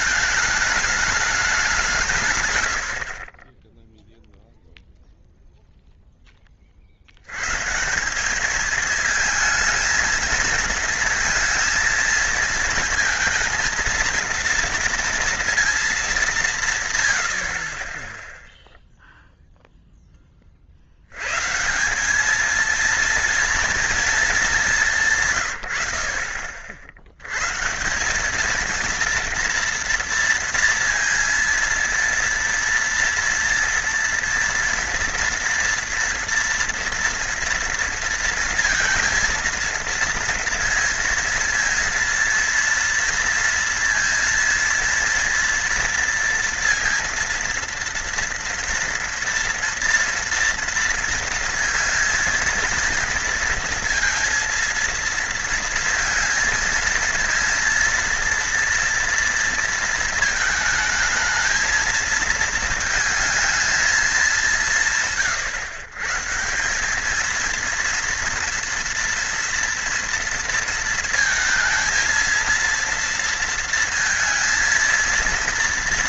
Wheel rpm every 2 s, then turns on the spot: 210, 100, 0, 40, 220, 230, 230, 230, 140, 0, 40, 220, 200, 50, 210, 230, 230, 230, 230, 230, 230, 230, 230, 230, 240, 230, 230, 230, 230, 230, 220, 220, 170, 180, 240, 230, 230, 230.
none